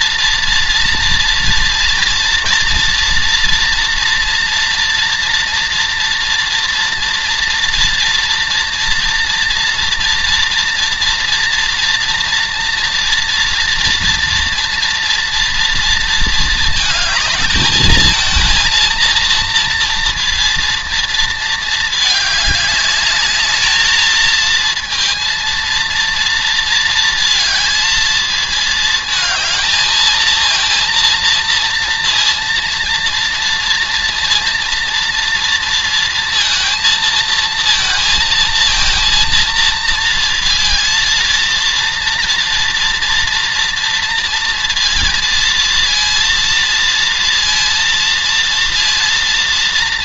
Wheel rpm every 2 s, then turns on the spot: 230, 230, 230, 230, 230, 240, 230, 230, 220, 230, 230, 210, 230, 230, 220, 230, 230, 230, 230, 230, 230, 230, 230, 230, 230.
none